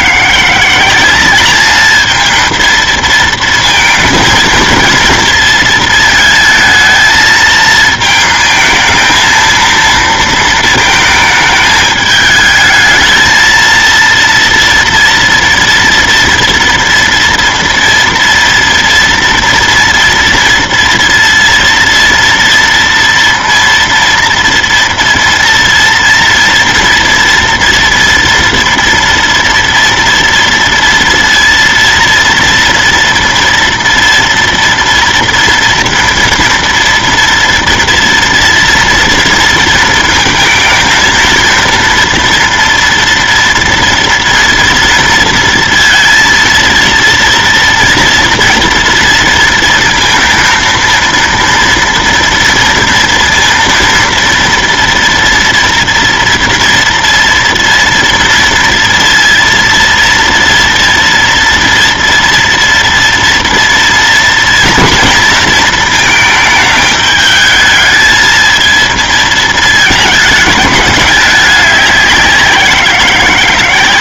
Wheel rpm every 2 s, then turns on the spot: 190, 230, 230, 220, 230, 220, 220, 230, 230, 230, 230, 230, 230, 230, 230, 230, 240, 230, 230, 230, 220, 230, 230, 230, 230, 230, 230, 230, 230, 230, 230, 230, 230, 210, 220, 210, 180.
none